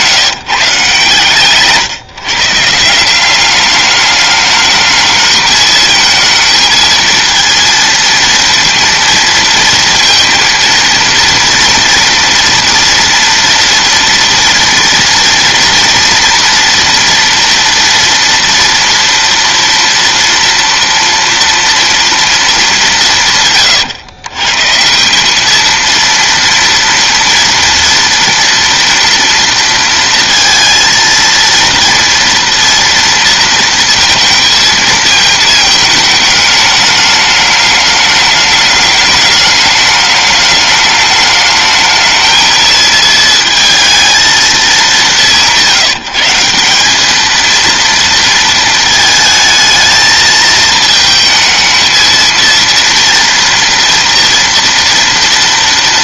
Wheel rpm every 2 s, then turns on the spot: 160, 150, 210, 220, 230, 230, 230, 230, 230, 230, 230, 210, 140, 230, 230, 230, 230, 220, 210, 210, 210, 220, 220, 190, 220, 220, 230, 230.
none